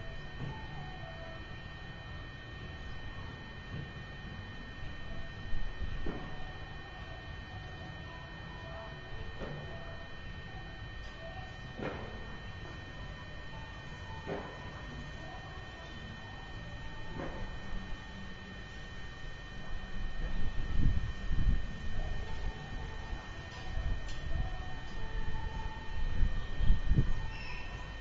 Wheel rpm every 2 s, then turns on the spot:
0, 0, 0, 0, 0, 0, 0, 0, 0, 0, 0, 0, 0, 0.
none